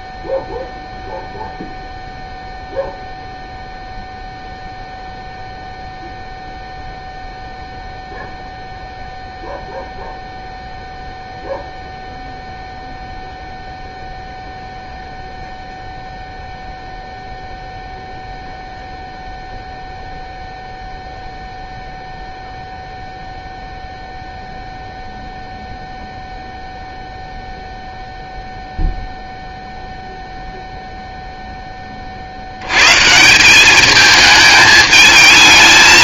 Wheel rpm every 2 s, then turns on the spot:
0, 0, 0, 0, 0, 0, 0, 0, 0, 0, 0, 0, 0, 0, 0, 0, 100, 220.
none